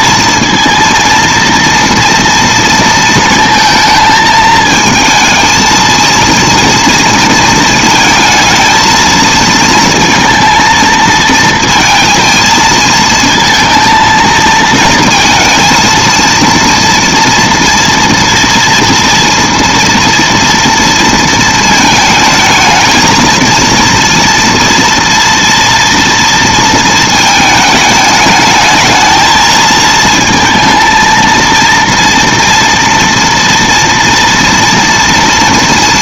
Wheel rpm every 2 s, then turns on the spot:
230, 230, 220, 230, 220, 230, 230, 220, 230, 230, 230, 220, 230, 230, 210, 230, 230, 230.
none